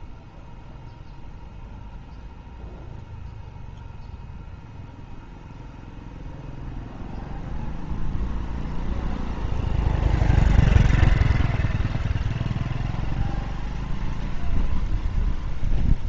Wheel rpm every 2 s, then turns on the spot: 0, 0, 0, 0, 0, 0, 0, 0.
none